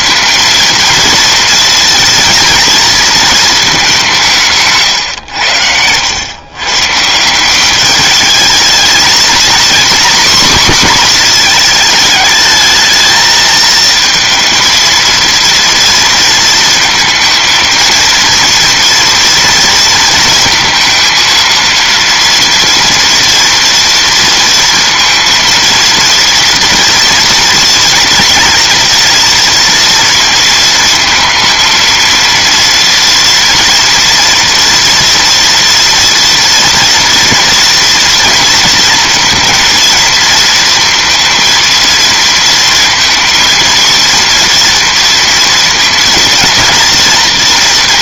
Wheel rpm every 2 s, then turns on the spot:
230, 230, 150, 130, 220, 250, 220, 230, 230, 230, 230, 230, 230, 240, 230, 230, 230, 230, 230, 230, 230, 230, 230, 230.
none